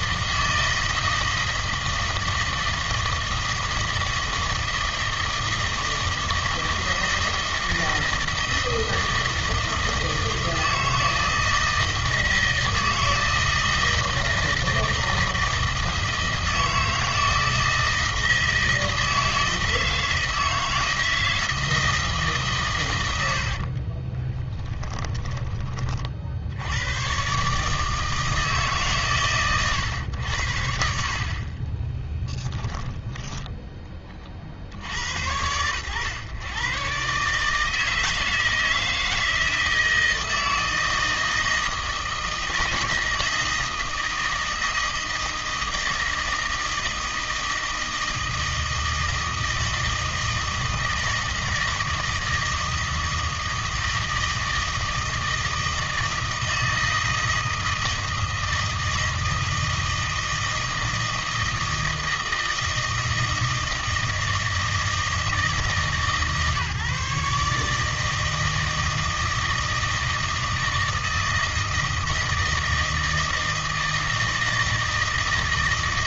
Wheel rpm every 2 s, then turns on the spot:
160, 160, 160, 160, 160, 160, 160, 160, 160, 160, 160, 110, 10, 100, 140, 60, 10, 80, 130, 160, 160, 160, 160, 160, 160, 160, 160, 160, 160, 160, 160, 160, 160, 150, 160, 160, 160, 160.
24-26 32-34